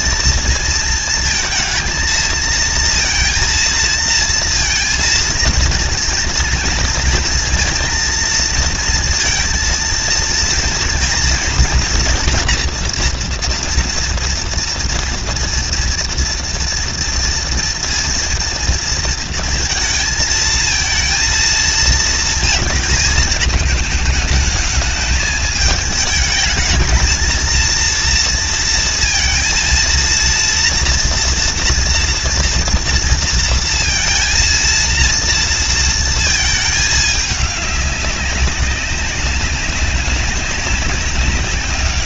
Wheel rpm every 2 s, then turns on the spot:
230, 220, 230, 230, 230, 220, 240, 230, 230, 230, 230, 220, 220, 220, 230, 230, 230, 230, 220, 190, 190.
none